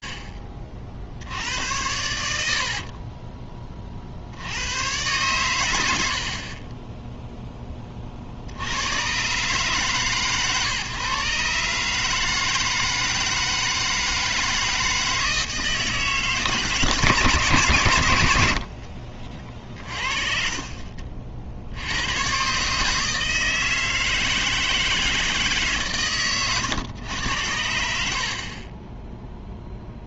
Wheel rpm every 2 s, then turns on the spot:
40, 20, 120, 10, 100, 130, 160, 160, 150, 40, 40, 160, 160, 110, 10.
2-4 18-20